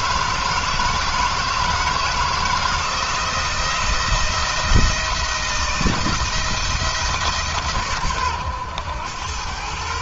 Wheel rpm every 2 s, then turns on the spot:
160, 170, 170, 170, 100.
none